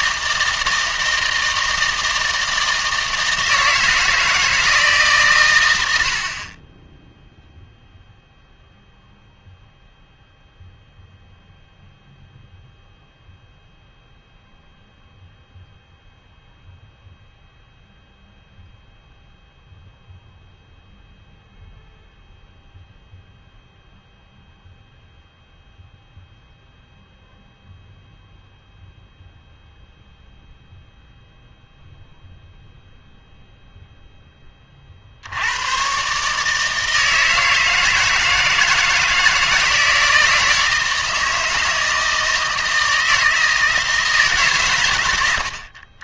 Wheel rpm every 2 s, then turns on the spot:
160, 160, 150, 10, 0, 0, 0, 0, 0, 0, 0, 0, 0, 0, 0, 0, 0, 30, 160, 160, 160, 160, 120.
none